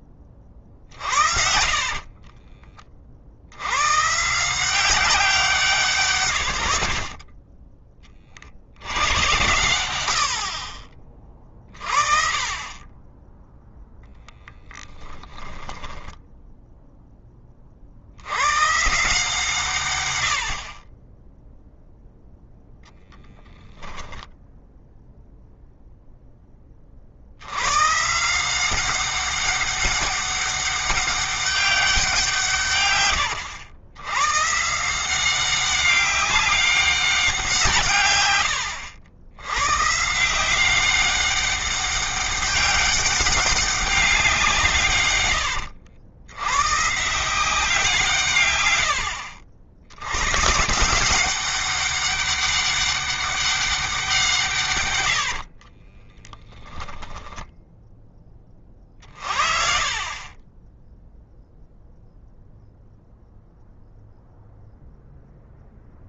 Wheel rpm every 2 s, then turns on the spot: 50, 30, 180, 70, 90, 30, 20, 10, 10, 140, 30, 10, 0, 30, 180, 200, 130, 160, 190, 90, 190, 200, 140, 150, 90, 180, 200, 110, 0, 40, 10, 0, 0.
0-2 6-8 14-16 54-56